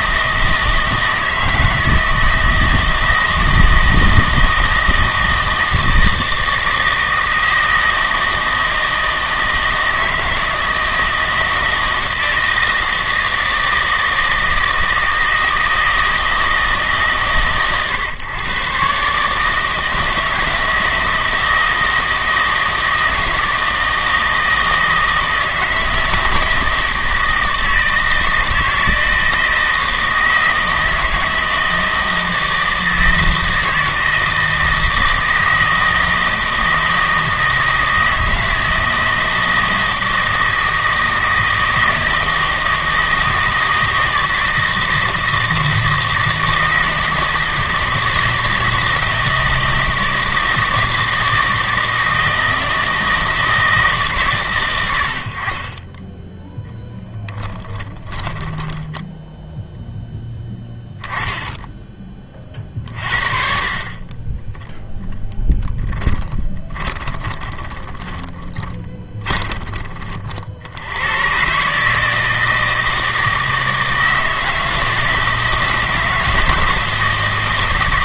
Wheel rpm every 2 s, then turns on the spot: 160, 160, 160, 160, 160, 160, 160, 160, 140, 130, 160, 160, 160, 160, 160, 160, 160, 160, 160, 160, 160, 160, 160, 160, 160, 160, 160, 100, 10, 10, 10, 40, 10, 10, 20, 80, 160, 160, 160.
56-60 66-70